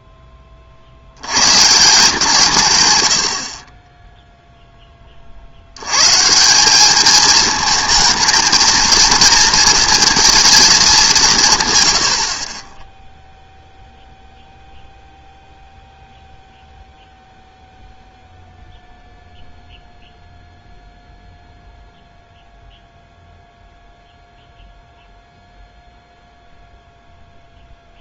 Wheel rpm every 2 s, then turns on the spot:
50, 160, 10, 200, 230, 210, 20, 0, 0, 0, 0, 0, 0, 0.
none